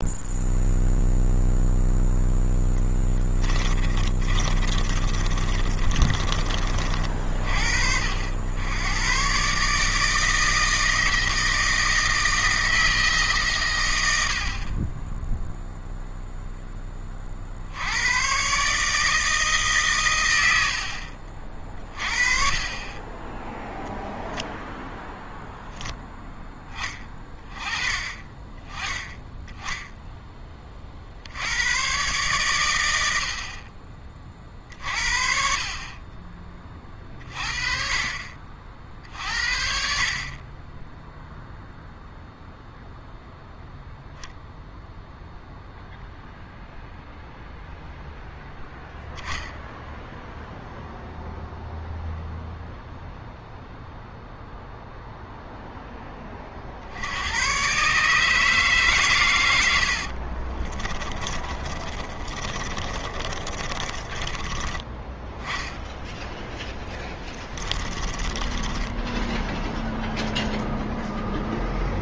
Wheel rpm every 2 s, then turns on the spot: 0, 10, 30, 40, 100, 160, 160, 30, 10, 150, 70, 30, 0, 10, 20, 30, 110, 50, 30, 50, 20, 0, 0, 0, 0, 0, 0, 0, 50, 150, 30, 30, 20, 20, 10, 0.
4-6 60-64 66-70